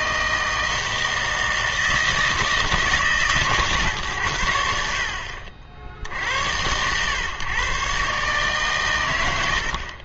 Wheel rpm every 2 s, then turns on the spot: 160, 160, 70, 100, 130.
none